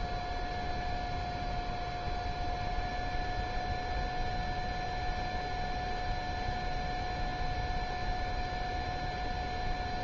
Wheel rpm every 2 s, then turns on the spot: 0, 0, 0, 0, 0.
none